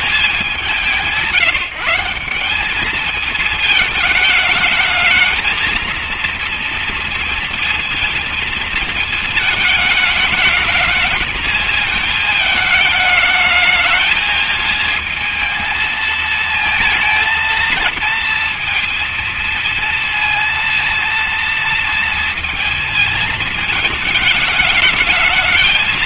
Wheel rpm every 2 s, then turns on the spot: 200, 200, 210, 230, 220, 220, 220, 230, 220, 230, 230, 230, 210.
none